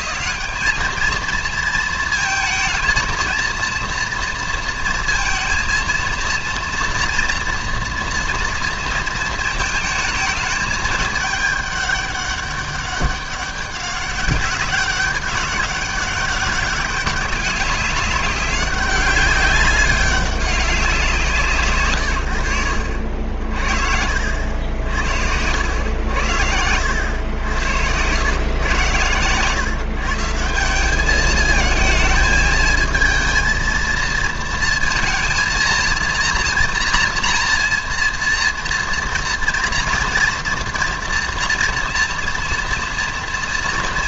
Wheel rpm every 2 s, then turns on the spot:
190, 230, 230, 230, 230, 220, 200, 190, 200, 200, 190, 80, 80, 80, 130, 180, 220, 230, 230, 230, 230, 230.
none